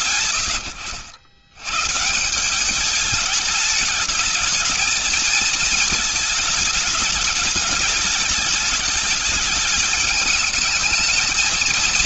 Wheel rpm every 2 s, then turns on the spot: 120, 190, 220, 220, 210, 220.
none